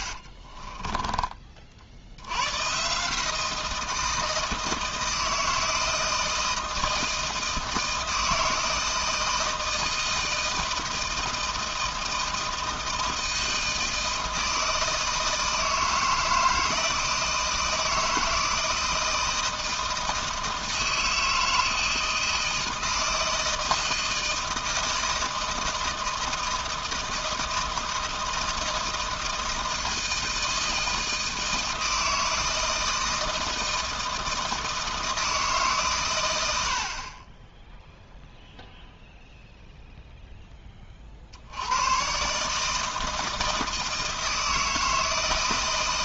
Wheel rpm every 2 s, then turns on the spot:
30, 120, 160, 160, 160, 160, 160, 160, 160, 160, 160, 160, 160, 160, 160, 160, 160, 160, 70, 0, 20, 150, 160.
0-2